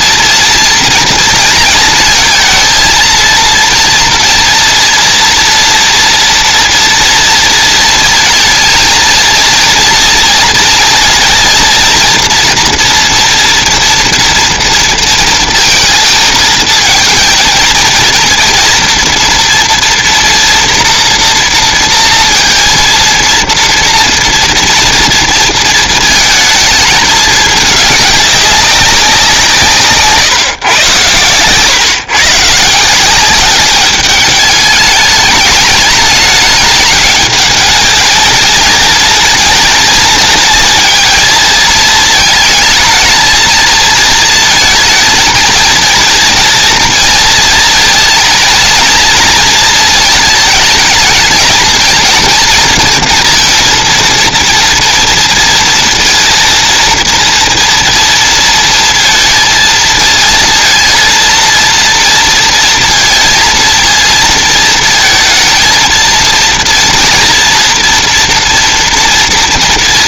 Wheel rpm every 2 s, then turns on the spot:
230, 230, 230, 240, 220, 230, 230, 230, 230, 230, 230, 230, 230, 220, 200, 130, 160, 210, 210, 230, 230, 230, 230, 230, 230, 220, 230, 230, 230, 230, 230, 230, 220, 230, 240.
none